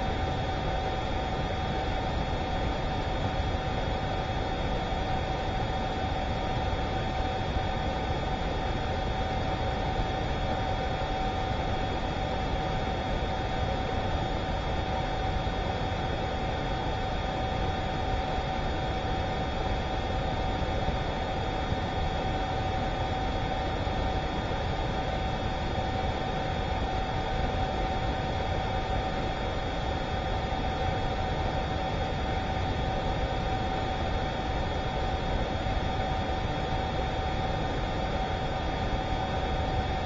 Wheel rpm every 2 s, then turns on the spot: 0, 0, 0, 0, 0, 0, 0, 0, 0, 0, 0, 0, 0, 0, 0, 0, 0, 0, 0, 0.
none